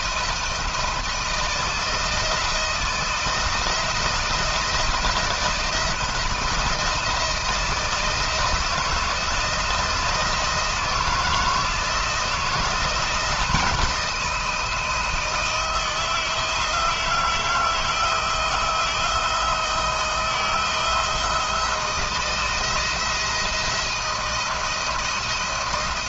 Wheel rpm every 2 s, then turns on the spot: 160, 160, 170, 170, 160, 160, 170, 160, 160, 160, 160, 170, 170.
none